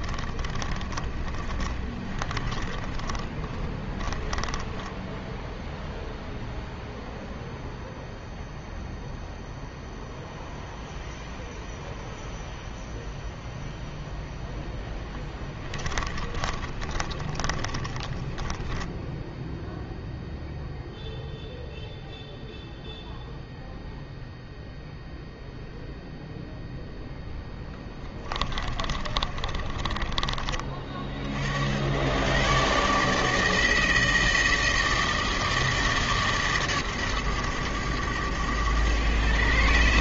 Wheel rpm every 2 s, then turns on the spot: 20, 20, 20, 0, 0, 0, 0, 0, 20, 10, 0, 0, 0, 0, 20, 30, 140, 160, 130, 100.
0-6 16-20 28-30